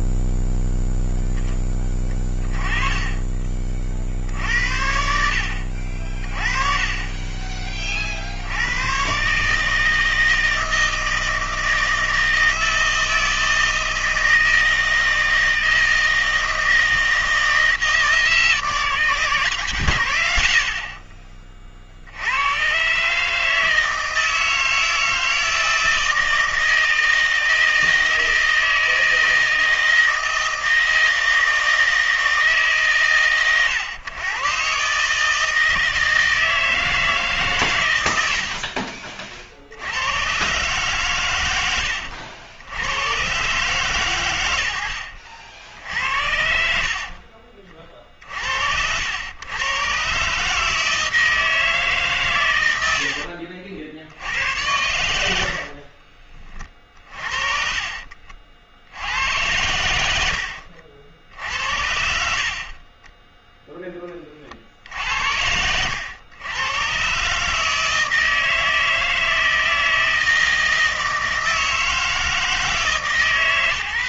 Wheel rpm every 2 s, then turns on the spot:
0, 20, 70, 20, 90, 160, 160, 160, 160, 160, 60, 130, 160, 160, 160, 160, 140, 130, 160, 50, 130, 80, 80, 60, 70, 150, 100, 90, 30, 70, 70, 40, 60, 110, 160, 160, 160.
6-8 20-22 38-40 62-64